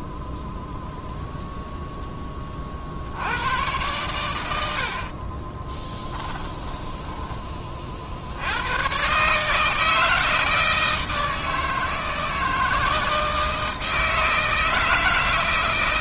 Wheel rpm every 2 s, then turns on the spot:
0, 50, 70, 10, 110, 160, 160, 160.
6-8